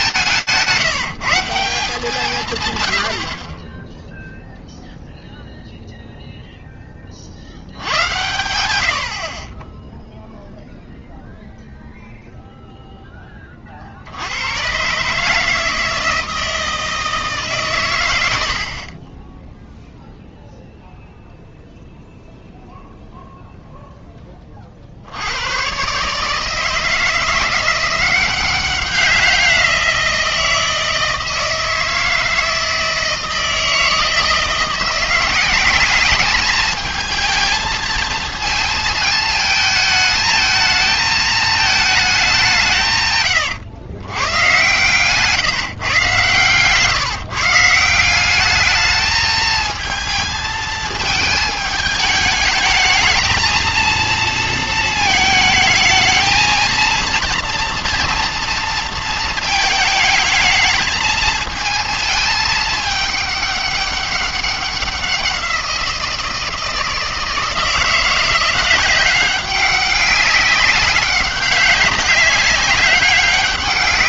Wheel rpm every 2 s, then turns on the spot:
170, 110, 0, 10, 100, 0, 0, 130, 160, 30, 0, 0, 60, 170, 190, 160, 160, 180, 220, 220, 220, 140, 130, 150, 210, 220, 220, 220, 230, 230, 220, 210, 190, 160, 180, 200, 200.
none